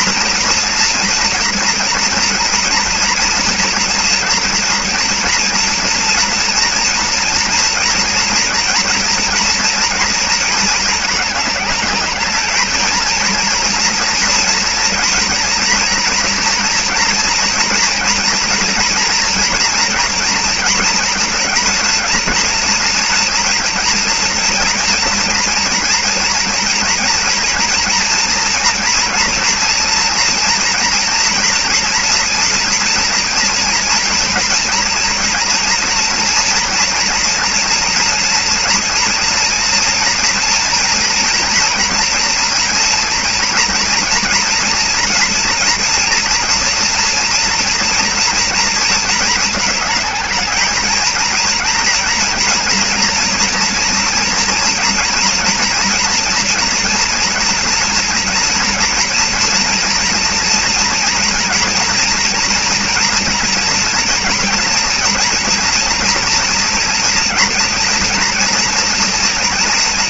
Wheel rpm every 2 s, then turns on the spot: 240, 230, 240, 230, 230, 220, 220, 230, 230, 230, 230, 230, 230, 230, 230, 230, 230, 230, 240, 230, 230, 230, 230, 230, 230, 220, 230, 240, 240, 230, 230, 240, 240, 230, 230.
none